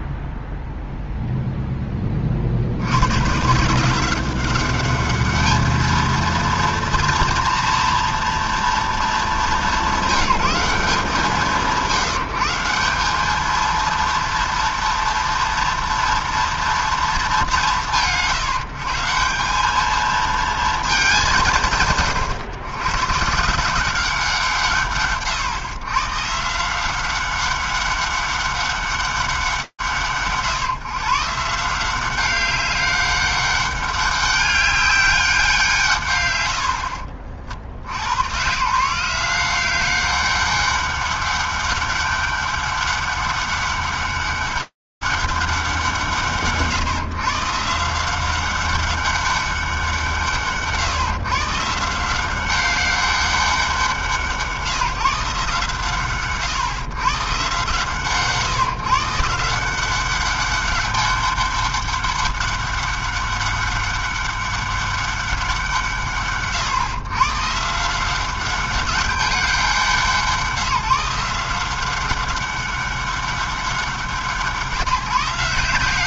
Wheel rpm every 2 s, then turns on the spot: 0, 50, 190, 230, 240, 180, 190, 230, 230, 150, 230, 110, 180, 150, 200, 130, 190, 190, 90, 150, 200, 200, 200, 140, 190, 130, 190, 150, 120, 140, 200, 190, 200, 100, 190, 160, 200, 160.
none